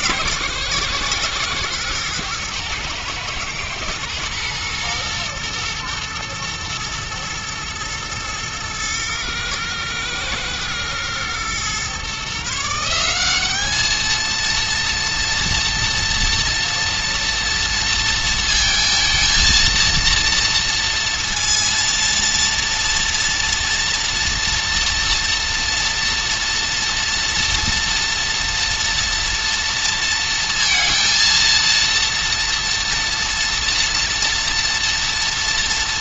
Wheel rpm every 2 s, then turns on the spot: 120, 110, 120, 110, 110, 110, 160, 230, 230, 230, 230, 230, 240, 230, 240, 230, 240, 240.
none